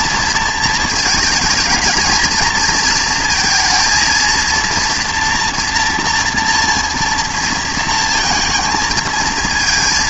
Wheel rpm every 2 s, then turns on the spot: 230, 220, 230, 230, 220.
none